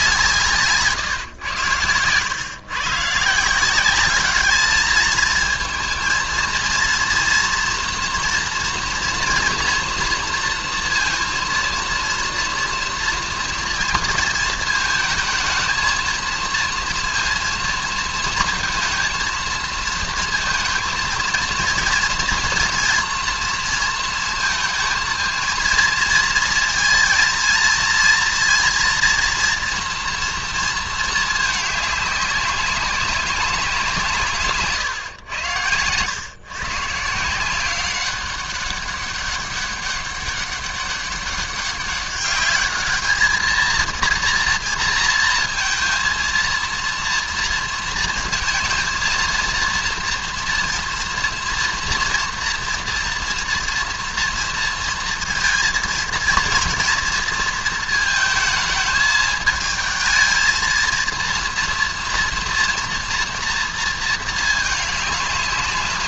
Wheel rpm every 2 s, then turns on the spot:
150, 130, 210, 230, 240, 230, 230, 220, 230, 230, 230, 230, 220, 230, 230, 230, 200, 150, 130, 190, 200, 210, 230, 230, 230, 230, 230, 230, 230, 220, 230, 230, 210.
34-36